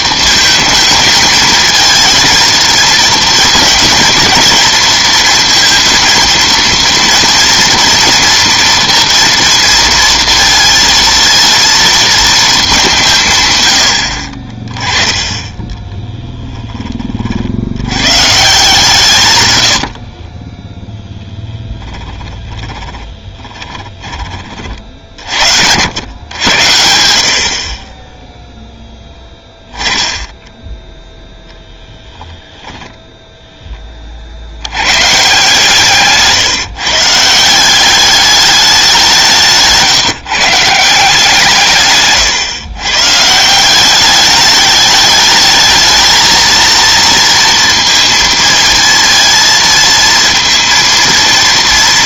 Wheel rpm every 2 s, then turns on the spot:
230, 230, 230, 230, 230, 230, 190, 20, 10, 140, 10, 20, 40, 90, 10, 0, 0, 110, 140, 190, 160, 130, 210, 230, 230, 230.
22-24 28-30